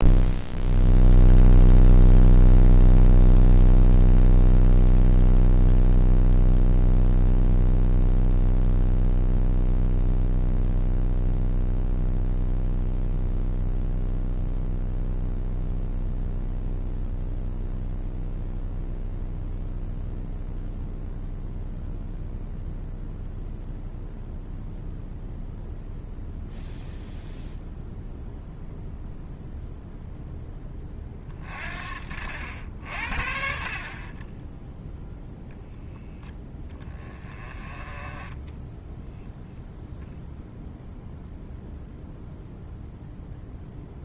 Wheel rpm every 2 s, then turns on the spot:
0, 0, 0, 0, 0, 0, 0, 0, 0, 0, 0, 0, 0, 0, 0, 10, 70, 10, 10, 10, 0, 0.
none